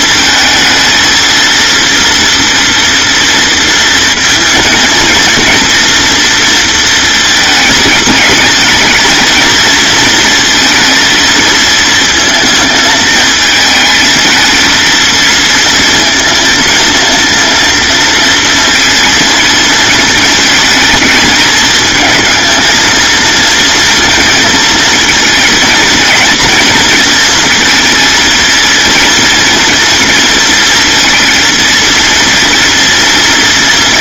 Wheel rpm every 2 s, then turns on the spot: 220, 240, 230, 230, 220, 230, 220, 230, 230, 230, 220, 230, 230, 230, 230, 230, 230.
none